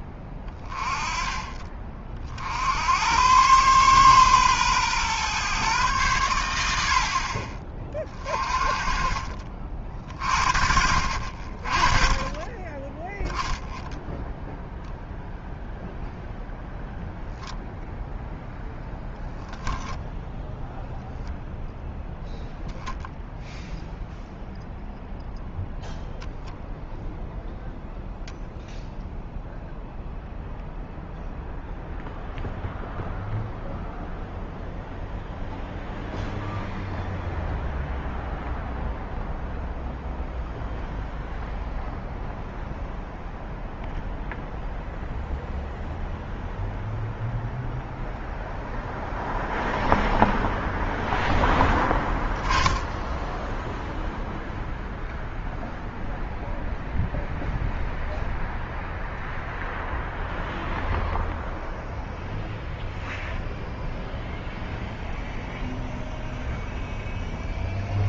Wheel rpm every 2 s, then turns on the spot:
20, 80, 130, 70, 40, 60, 20, 0, 0, 0, 0, 0, 0, 10, 0, 0, 0, 0, 0, 0, 0, 0, 0, 0, 0, 0, 20, 0, 0, 0, 0, 0, 0, 0.
none